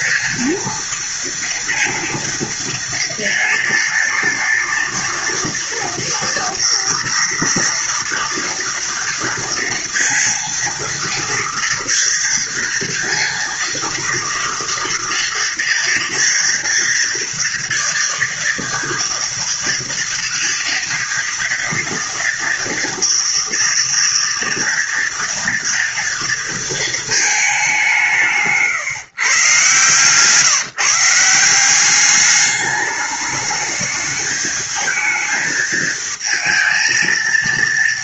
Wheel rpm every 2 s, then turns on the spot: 230, 230, 230, 230, 230, 230, 230, 230, 230, 230, 230, 230, 240, 230, 150, 150, 210, 220, 220.
none